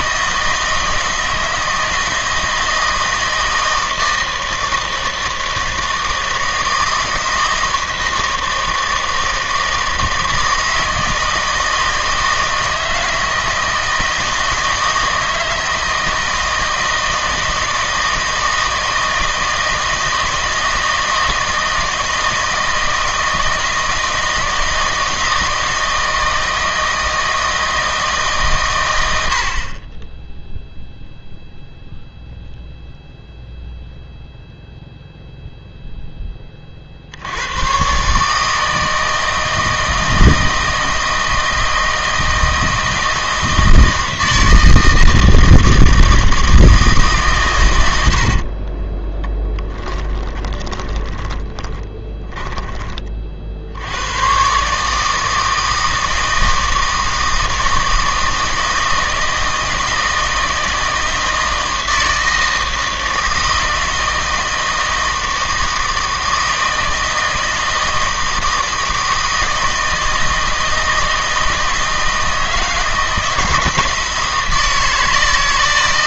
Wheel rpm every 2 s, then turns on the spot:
160, 160, 160, 160, 160, 160, 160, 160, 160, 160, 160, 160, 160, 160, 130, 0, 0, 0, 30, 160, 160, 160, 160, 160, 40, 20, 20, 140, 160, 160, 160, 160, 160, 160, 160, 160, 160, 160.
48-52